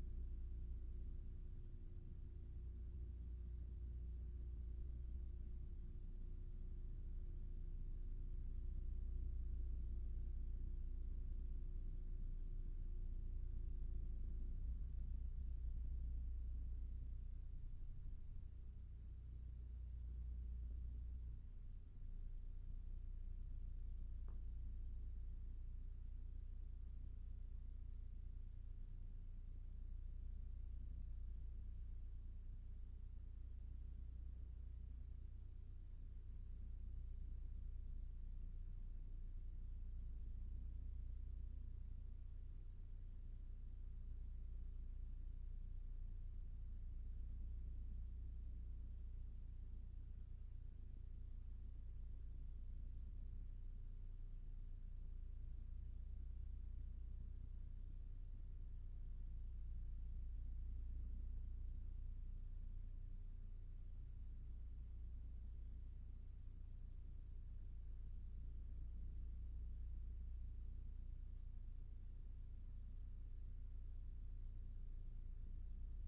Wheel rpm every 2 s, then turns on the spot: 0, 0, 0, 0, 0, 0, 0, 0, 0, 0, 0, 0, 0, 0, 0, 0, 0, 0, 0, 0, 0, 0, 0, 0, 0, 0, 0, 0, 0, 0, 0, 0, 0, 0, 0, 0, 0, 0.
none